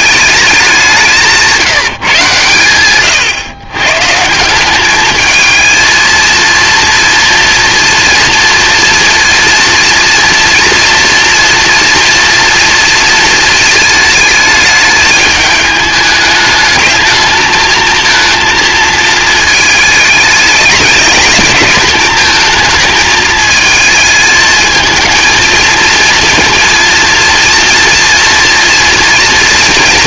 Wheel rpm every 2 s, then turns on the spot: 160, 130, 210, 230, 230, 230, 230, 210, 220, 220, 210, 220, 220, 230, 230.
none